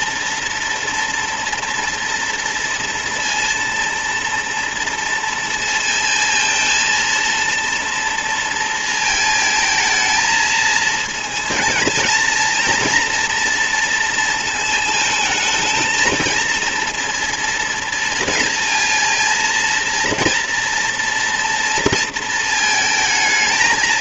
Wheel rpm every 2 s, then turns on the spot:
230, 230, 230, 230, 220, 220, 230, 230, 230, 230, 230, 220.
none